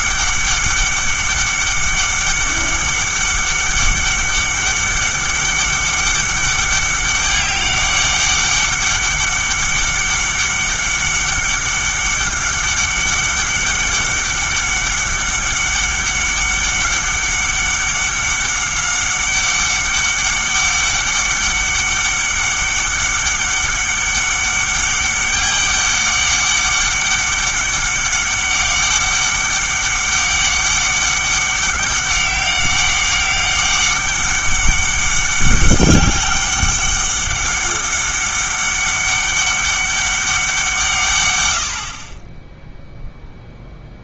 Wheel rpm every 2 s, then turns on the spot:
200, 200, 200, 200, 200, 200, 200, 200, 200, 200, 200, 200, 200, 200, 200, 200, 200, 200, 200, 200, 170, 0.
none